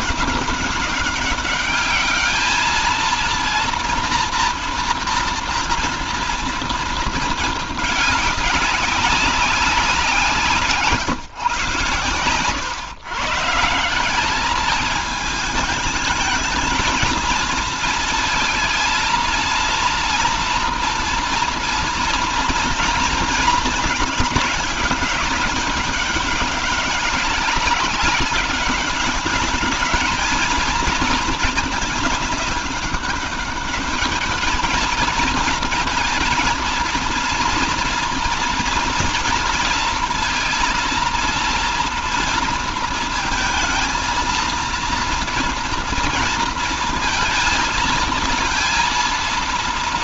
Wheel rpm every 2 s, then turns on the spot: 200, 220, 230, 230, 200, 170, 120, 220, 230, 230, 230, 230, 210, 200, 200, 230, 200, 220, 220, 230, 230, 230, 230, 230, 230.
none